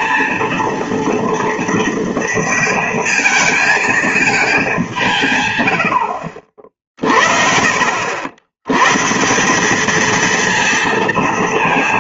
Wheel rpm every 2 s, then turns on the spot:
230, 220, 200, 50, 110, 230.
none